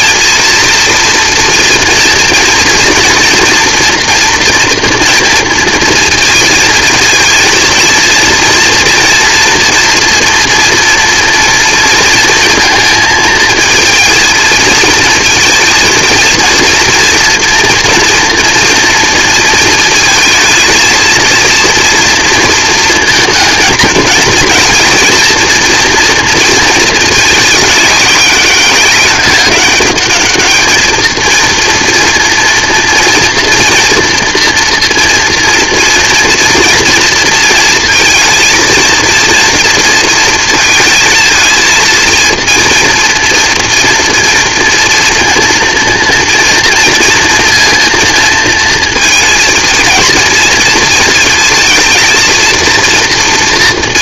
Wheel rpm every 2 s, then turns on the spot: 230, 230, 230, 230, 230, 240, 230, 230, 230, 230, 220, 230, 240, 220, 200, 220, 230, 230, 230, 230, 230, 230, 230, 230, 230, 220, 230.
none